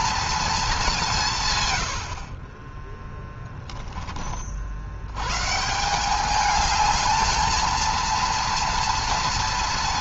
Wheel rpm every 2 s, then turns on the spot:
220, 30, 50, 210, 230.
2-4